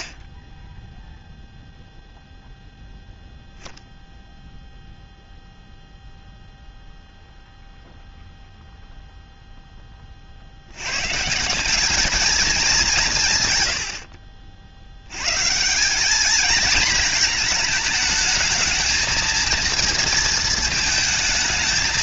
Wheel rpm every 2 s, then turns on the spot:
0, 0, 0, 0, 150, 150, 110, 220, 230, 220, 230.
none